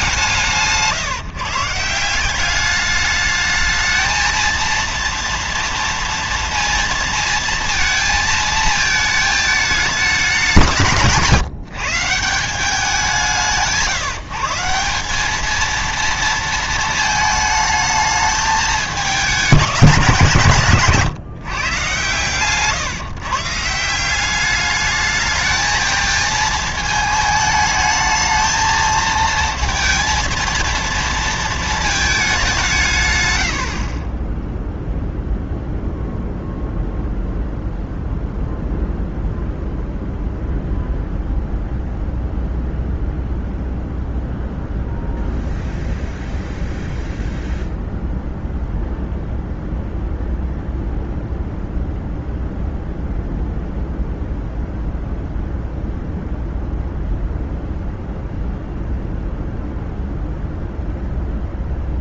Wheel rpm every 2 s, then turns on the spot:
150, 200, 230, 230, 220, 180, 180, 180, 230, 210, 150, 140, 210, 220, 220, 230, 180, 0, 0, 0, 0, 0, 0, 0, 0, 0, 0, 0, 0, 0, 0.
20-22